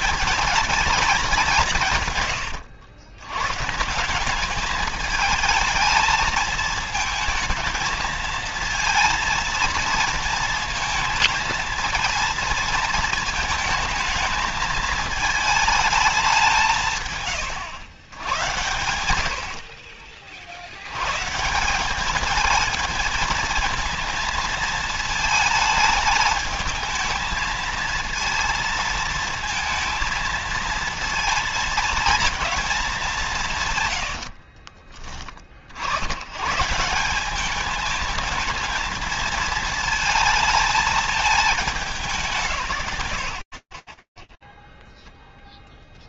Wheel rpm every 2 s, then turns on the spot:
220, 90, 210, 220, 220, 230, 230, 220, 160, 90, 90, 220, 220, 220, 230, 230, 200, 40, 160, 220, 220, 120, 0.
18-20 34-36